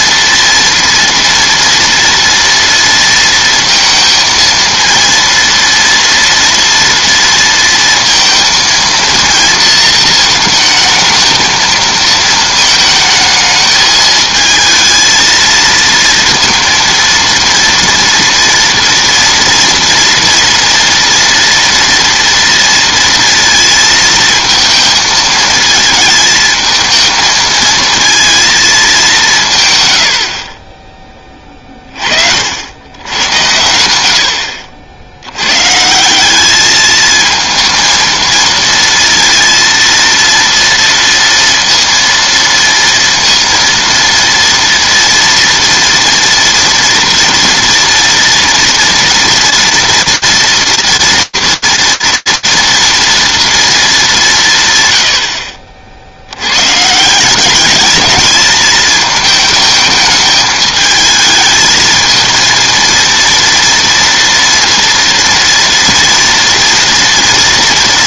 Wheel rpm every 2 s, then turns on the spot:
230, 230, 230, 230, 220, 220, 220, 220, 230, 230, 230, 230, 230, 220, 230, 40, 70, 70, 210, 230, 230, 230, 230, 230, 240, 240, 240, 110, 150, 220, 220, 230, 230, 230.
none